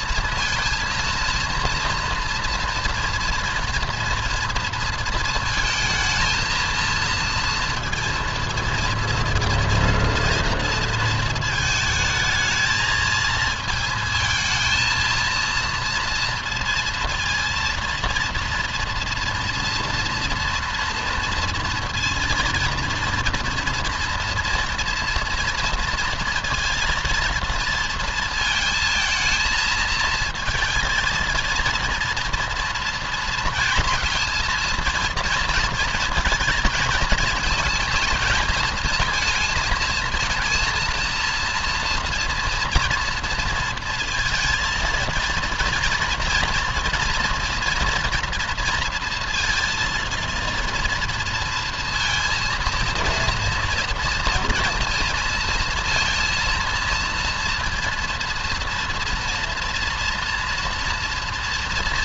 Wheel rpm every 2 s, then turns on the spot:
230, 230, 230, 230, 230, 230, 220, 230, 230, 230, 230, 230, 230, 230, 220, 230, 230, 220, 230, 220, 230, 230, 230, 230, 230, 230, 230, 230, 230, 230, 230.
none